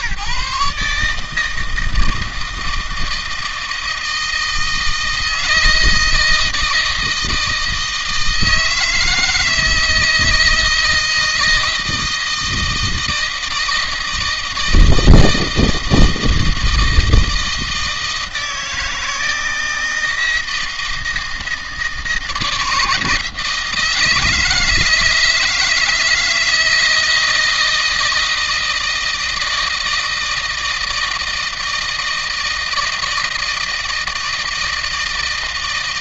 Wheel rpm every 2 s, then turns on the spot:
140, 160, 160, 160, 160, 160, 160, 160, 160, 160, 160, 170, 160, 170, 160, 160, 160, 160.
none